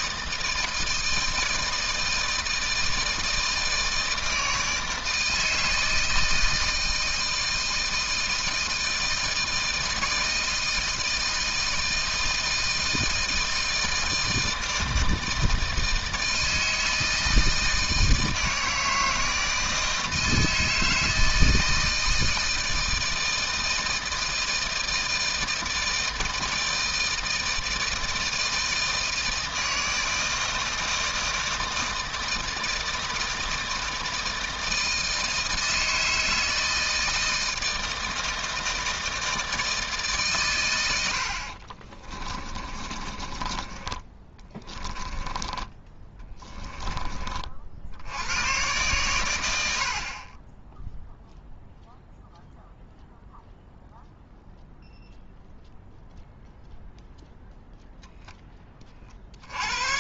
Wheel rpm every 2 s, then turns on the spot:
160, 160, 160, 160, 160, 160, 160, 160, 160, 160, 160, 160, 160, 160, 160, 160, 160, 160, 160, 160, 100, 30, 10, 20, 120, 0, 0, 0, 0, 30.
42-46